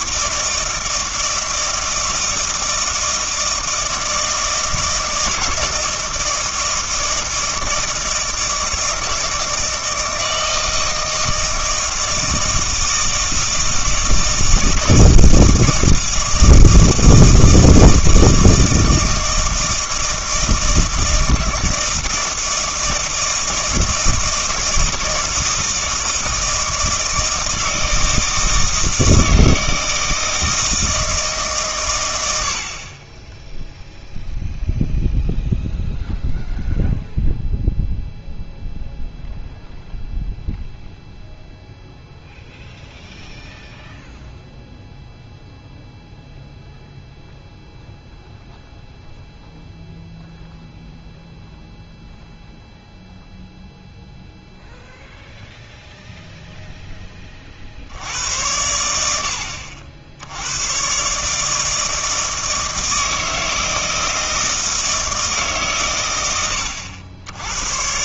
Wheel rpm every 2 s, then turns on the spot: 160, 160, 160, 160, 160, 160, 160, 160, 160, 160, 160, 160, 160, 160, 160, 160, 50, 0, 0, 0, 0, 0, 0, 0, 0, 0, 0, 0, 0, 80, 120, 160, 160, 90.
none